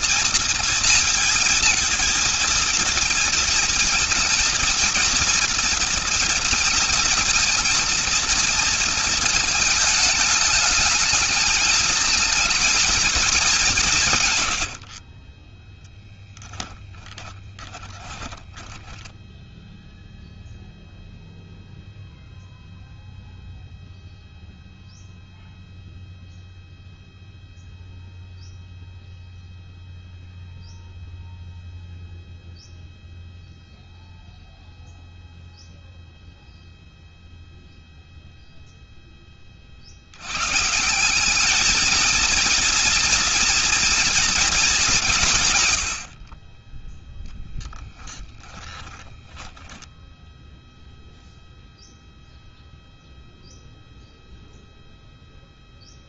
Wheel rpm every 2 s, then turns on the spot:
230, 230, 230, 230, 220, 220, 210, 50, 20, 10, 0, 0, 0, 0, 0, 0, 0, 0, 0, 0, 150, 230, 210, 20, 10, 0, 0, 0.
14-20 48-50